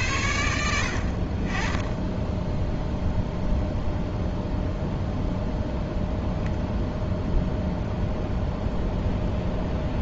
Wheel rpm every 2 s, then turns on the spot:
70, 0, 0, 10, 0.
none